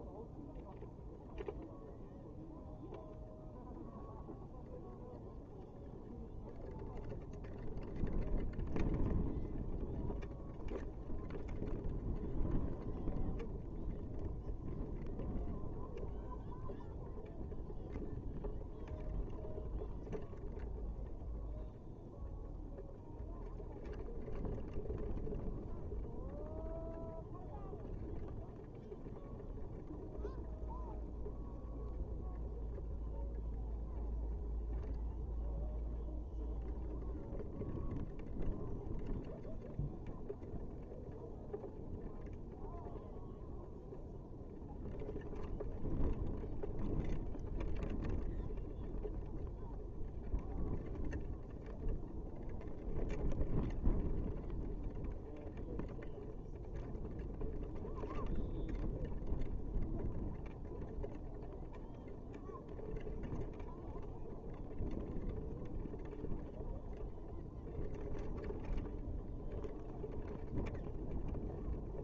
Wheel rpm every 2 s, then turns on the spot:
0, 0, 0, 0, 0, 0, 0, 0, 0, 0, 0, 0, 0, 0, 0, 0, 0, 0, 0, 0, 0, 0, 0, 0, 0, 0, 0, 0, 0, 0, 0, 0, 0, 0, 0, 0.
none